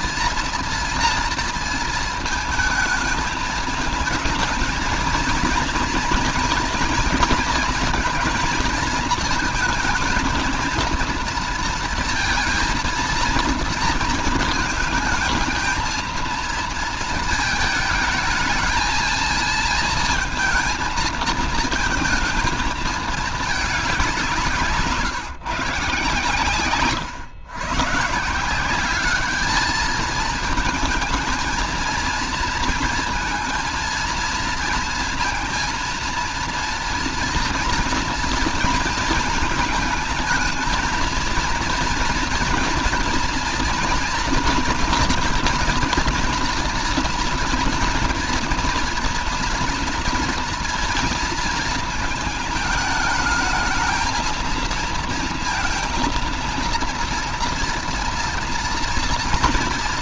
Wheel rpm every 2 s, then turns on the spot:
230, 220, 220, 230, 230, 230, 230, 220, 230, 220, 220, 230, 190, 140, 180, 220, 230, 230, 230, 230, 220, 230, 230, 230, 230, 230, 220, 230, 230, 240.
none